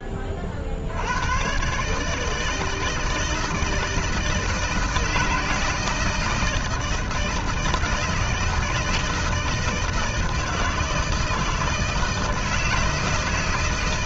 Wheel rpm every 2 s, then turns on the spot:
80, 160, 160, 160, 160, 160, 160.
none